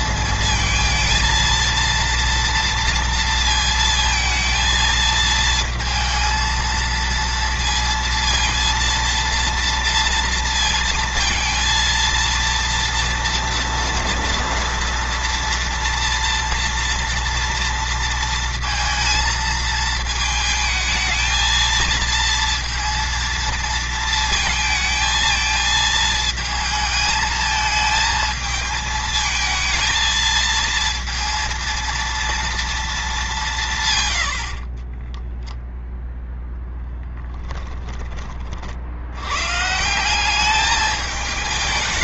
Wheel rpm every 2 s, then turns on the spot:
230, 230, 230, 230, 230, 230, 230, 230, 230, 230, 220, 230, 220, 220, 220, 230, 220, 30, 10, 60, 210.
34-36